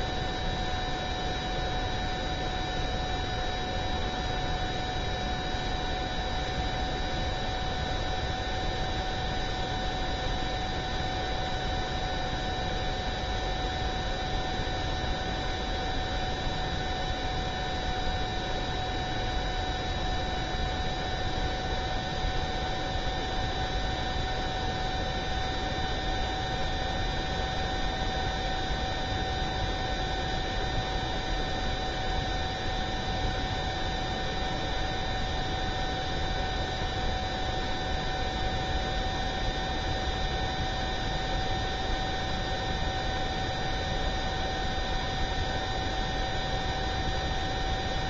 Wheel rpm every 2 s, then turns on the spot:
0, 0, 0, 0, 0, 0, 0, 0, 0, 0, 0, 0, 0, 0, 0, 0, 0, 0, 0, 0, 0, 0, 0, 0.
none